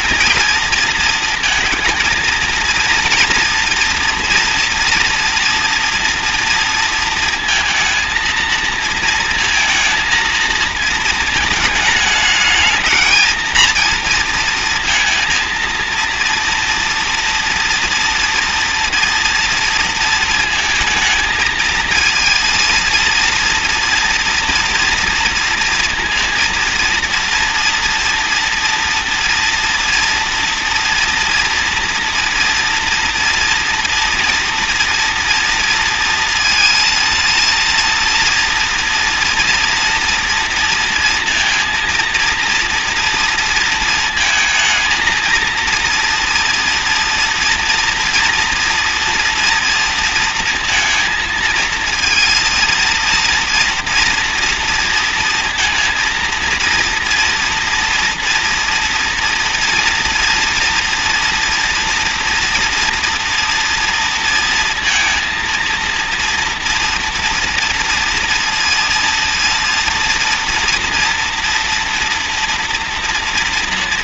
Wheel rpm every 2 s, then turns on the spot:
230, 230, 230, 230, 230, 220, 210, 230, 230, 230, 230, 230, 230, 230, 230, 240, 240, 230, 230, 230, 240, 230, 220, 230, 230, 230, 230, 230, 230, 230, 230, 230, 230, 230, 230, 230, 230.
none